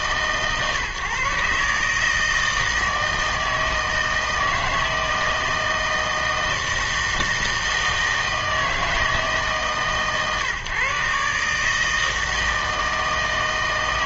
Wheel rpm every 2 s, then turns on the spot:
140, 160, 160, 160, 160, 140, 160.
none